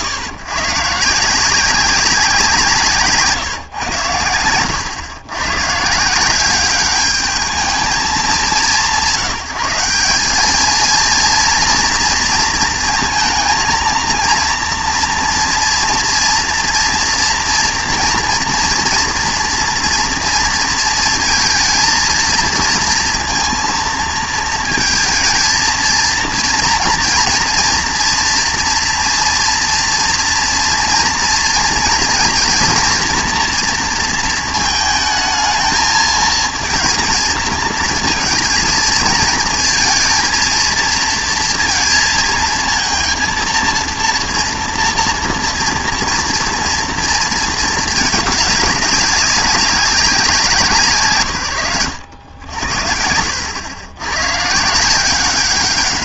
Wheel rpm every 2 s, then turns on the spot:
110, 180, 110, 190, 180, 210, 230, 230, 230, 230, 230, 230, 230, 230, 230, 230, 230, 220, 230, 230, 230, 230, 230, 230, 210, 150, 90, 140.
none